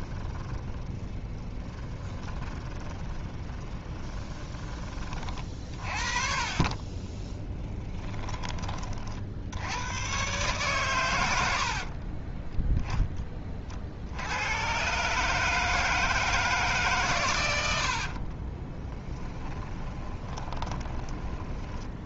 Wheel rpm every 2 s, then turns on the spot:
20, 20, 20, 40, 40, 120, 10, 120, 150, 20, 20.
0-4 6-8 18-22